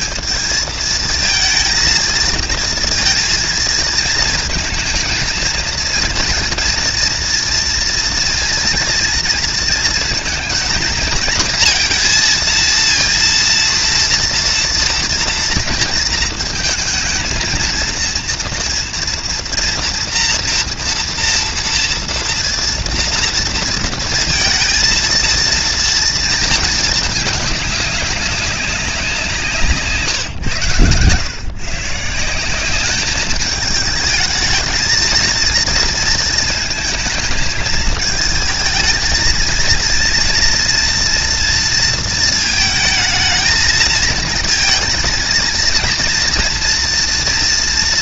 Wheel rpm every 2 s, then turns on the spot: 220, 230, 220, 230, 230, 220, 230, 230, 230, 230, 230, 230, 230, 220, 190, 130, 200, 230, 220, 230, 240, 220, 230, 230.
none